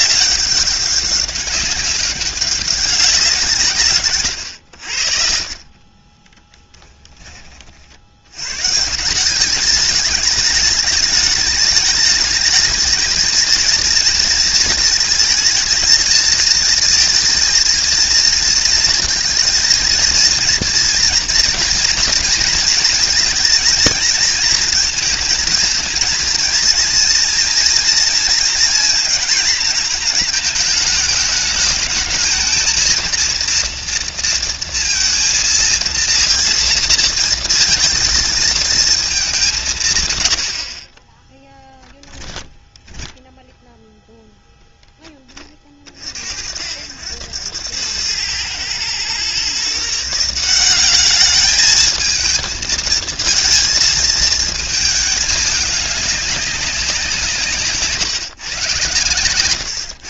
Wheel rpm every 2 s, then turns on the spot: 200, 200, 80, 10, 130, 210, 210, 230, 230, 230, 230, 230, 230, 230, 230, 220, 220, 230, 230, 230, 60, 10, 0, 60, 110, 190, 230, 220, 190, 130.
6-8 42-44